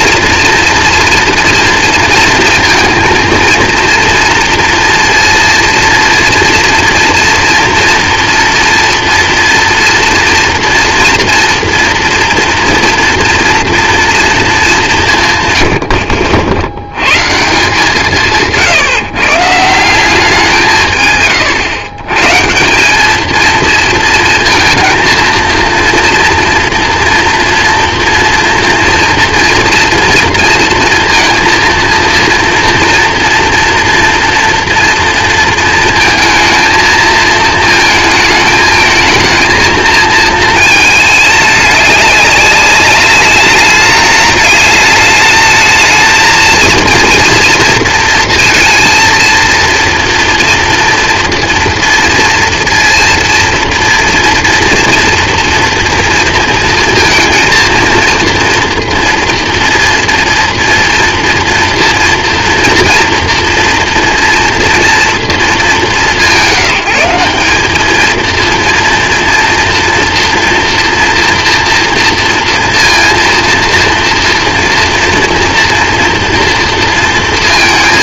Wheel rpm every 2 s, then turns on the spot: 230, 230, 230, 230, 230, 230, 230, 200, 80, 150, 160, 180, 230, 230, 230, 230, 230, 230, 220, 220, 220, 200, 210, 230, 230, 240, 230, 230, 230, 230, 230, 230, 230, 180, 230, 230, 230, 230, 230.
none